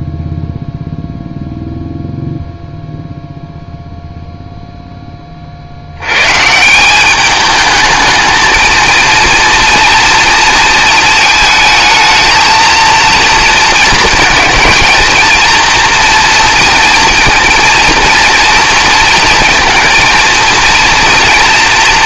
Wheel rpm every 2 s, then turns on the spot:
0, 0, 0, 170, 220, 230, 230, 230, 240, 230, 230.
none